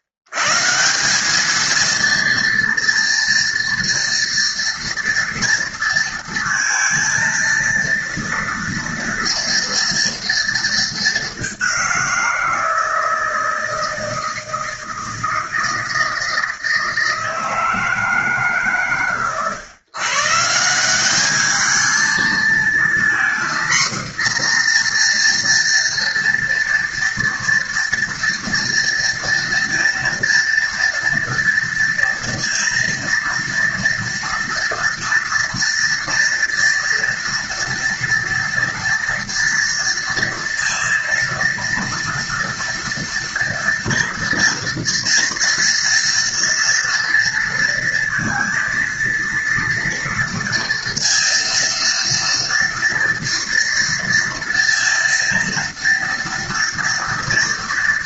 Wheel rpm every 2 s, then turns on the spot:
110, 230, 230, 230, 230, 230, 170, 160, 160, 150, 160, 230, 240, 230, 230, 230, 230, 230, 230, 230, 230, 230, 230, 230, 230, 230, 230, 230, 230.
none